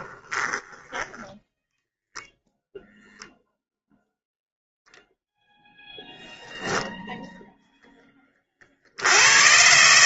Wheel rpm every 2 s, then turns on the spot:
0, 0, 0, 60, 160.
none